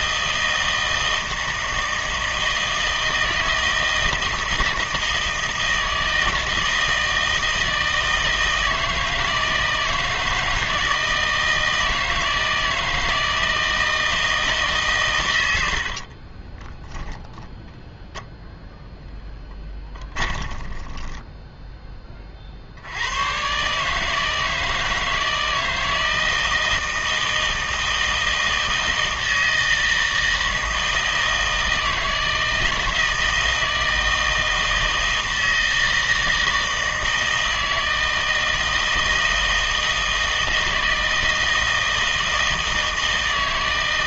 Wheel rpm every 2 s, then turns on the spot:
160, 160, 160, 160, 160, 160, 160, 150, 10, 0, 20, 70, 160, 160, 160, 160, 160, 160, 160, 160, 160, 160.
16-18 20-22